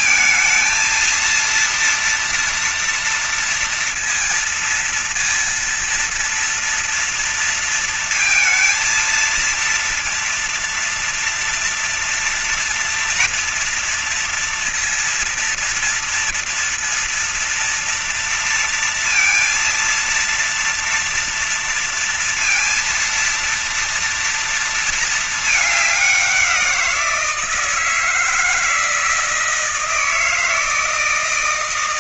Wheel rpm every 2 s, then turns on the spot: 230, 230, 230, 230, 230, 230, 230, 230, 230, 230, 230, 230, 230, 170, 160, 160.
none